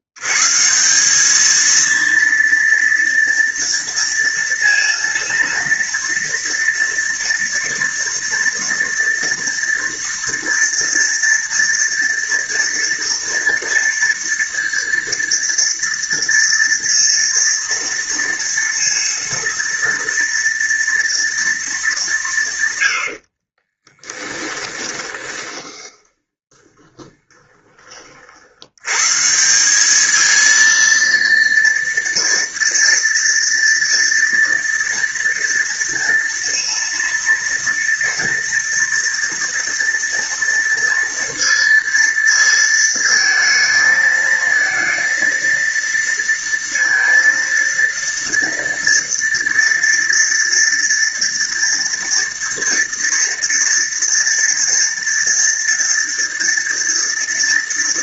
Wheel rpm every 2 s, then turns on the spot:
100, 230, 230, 230, 240, 230, 230, 230, 230, 230, 230, 160, 10, 20, 60, 220, 230, 230, 230, 230, 230, 230, 220, 230, 230, 230, 230, 230, 230.
24-28